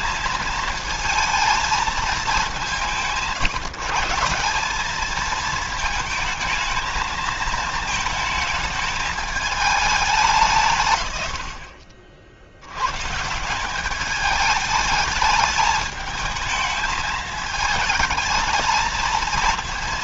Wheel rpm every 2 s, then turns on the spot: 220, 180, 200, 220, 220, 140, 100, 210, 220, 220.
none